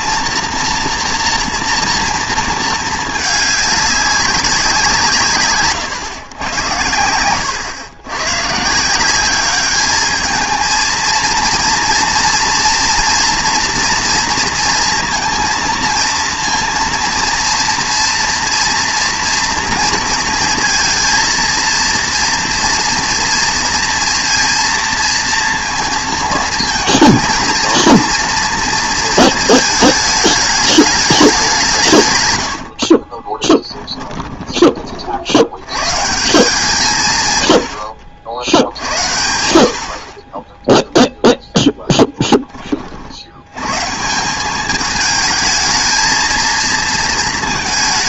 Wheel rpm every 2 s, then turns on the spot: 230, 220, 170, 100, 170, 230, 230, 230, 230, 230, 230, 230, 230, 220, 230, 210, 50, 40, 160, 50, 0, 40, 210, 230.
32-34